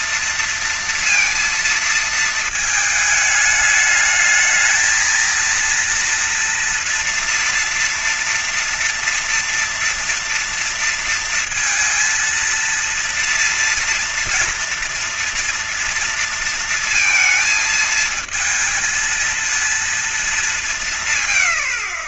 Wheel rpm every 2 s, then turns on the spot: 230, 220, 220, 240, 230, 230, 230, 230, 230, 220, 210.
none